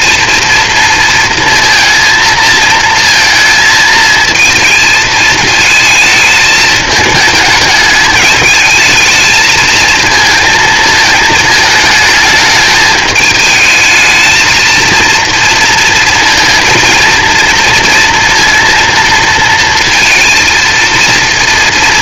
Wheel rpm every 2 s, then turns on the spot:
230, 230, 220, 220, 220, 220, 220, 220, 230, 230, 230.
none